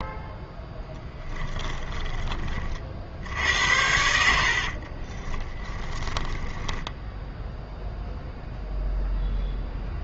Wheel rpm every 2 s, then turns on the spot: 0, 40, 60, 10, 0.
4-8